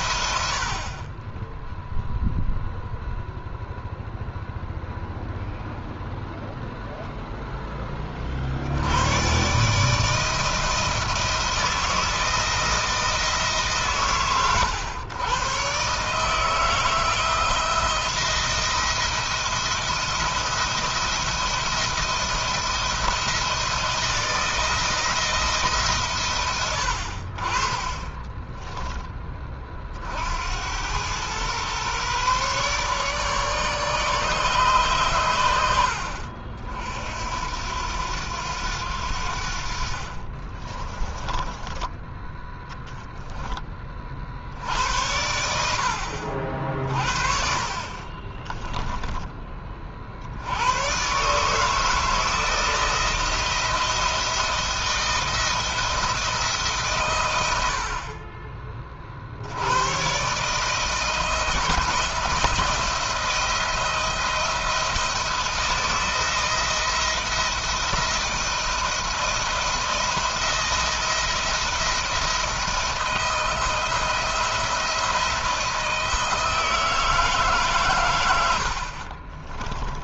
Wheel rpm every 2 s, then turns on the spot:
40, 0, 0, 0, 110, 160, 160, 110, 160, 170, 170, 170, 170, 70, 20, 100, 140, 130, 60, 80, 20, 0, 80, 50, 10, 130, 170, 170, 120, 40, 160, 170, 170, 170, 170, 170, 170, 170, 160, 50.
40-42 78-80